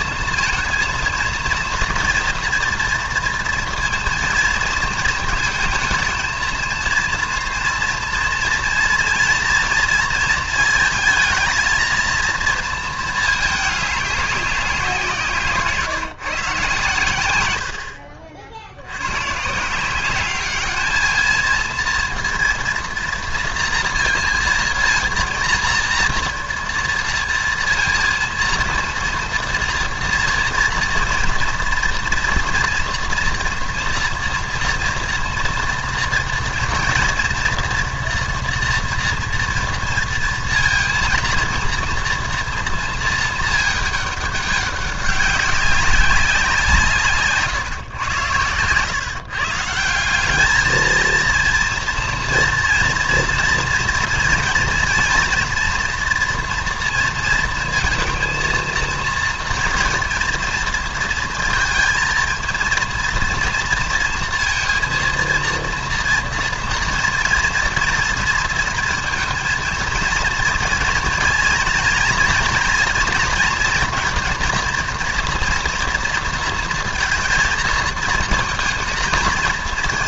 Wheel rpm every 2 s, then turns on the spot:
230, 230, 230, 230, 230, 220, 230, 190, 130, 70, 210, 230, 230, 230, 230, 240, 230, 240, 230, 230, 230, 230, 200, 180, 110, 210, 230, 230, 230, 230, 230, 230, 230, 230, 230, 230, 230, 230, 230, 230.
48-50